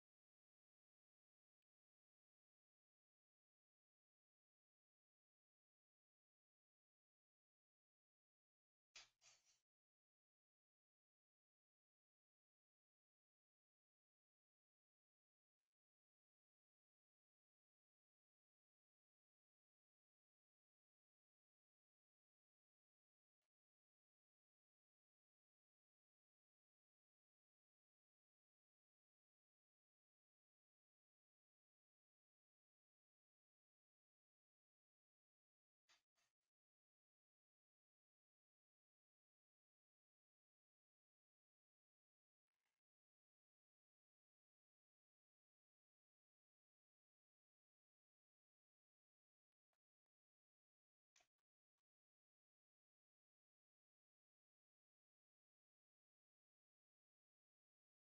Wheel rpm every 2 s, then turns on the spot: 0, 0, 0, 0, 0, 0, 0, 0, 0, 0, 0, 0, 0, 0, 0, 0, 0, 0, 0, 0, 0, 0, 0, 0, 0, 0, 0, 0, 0.
none